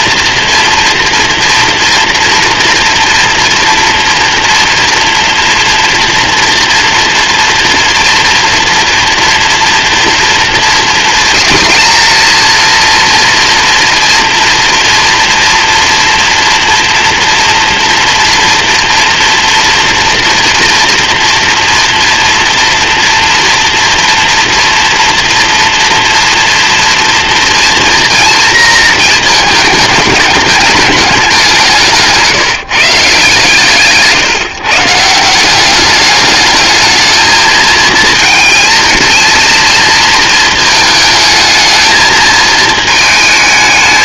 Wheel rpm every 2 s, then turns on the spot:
230, 230, 240, 230, 230, 230, 230, 240, 230, 230, 230, 230, 230, 230, 230, 200, 160, 180, 220, 230, 220, 220.
none